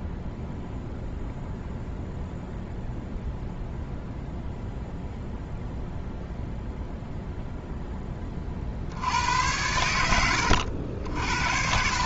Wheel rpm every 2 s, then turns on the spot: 0, 0, 0, 0, 60, 80.
none